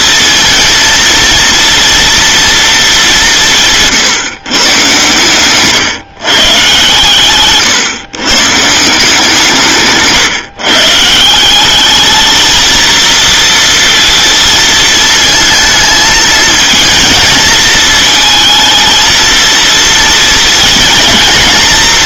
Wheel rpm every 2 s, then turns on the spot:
230, 230, 130, 130, 160, 140, 220, 230, 220, 230, 230.
none